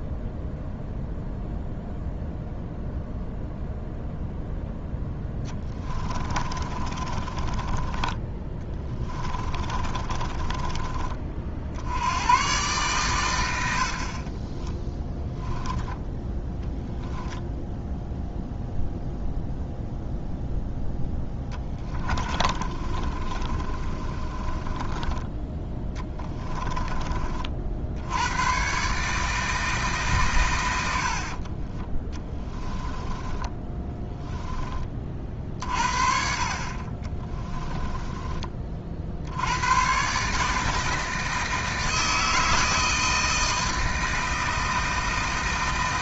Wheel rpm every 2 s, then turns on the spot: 0, 0, 0, 30, 20, 20, 120, 20, 0, 0, 0, 30, 20, 20, 130, 100, 10, 20, 40, 40, 160, 160, 160.
6-12 14-16 22-28 32-34